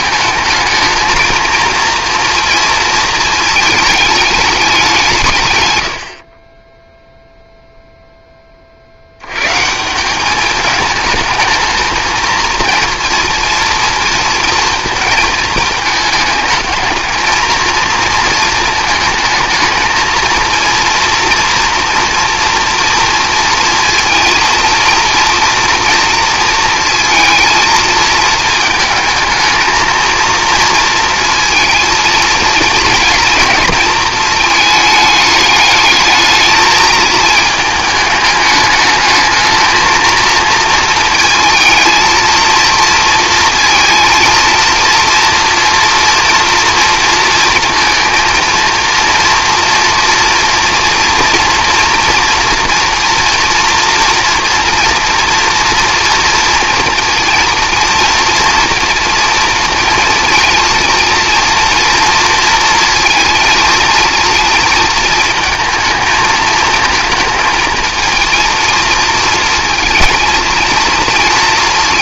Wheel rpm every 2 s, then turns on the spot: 220, 230, 200, 10, 40, 210, 220, 230, 220, 220, 230, 230, 230, 230, 220, 230, 230, 210, 220, 210, 230, 230, 230, 240, 230, 230, 230, 230, 230, 230, 230, 230, 220, 220, 230, 230.
none